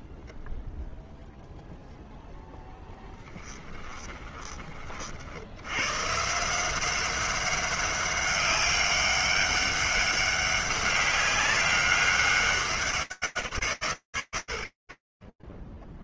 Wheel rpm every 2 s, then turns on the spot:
0, 10, 50, 180, 200, 200, 190, 80.
2-4